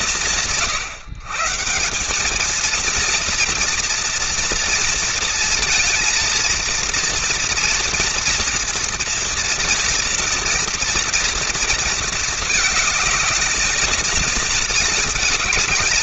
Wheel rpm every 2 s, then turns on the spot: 130, 230, 230, 240, 230, 230, 220, 220.
none